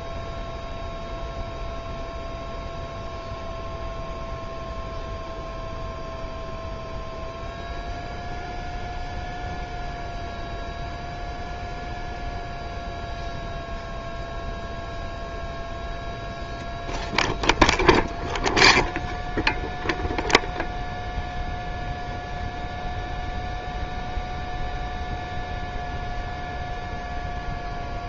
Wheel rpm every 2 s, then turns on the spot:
0, 0, 0, 0, 0, 0, 0, 0, 0, 0, 0, 0, 0, 0.
none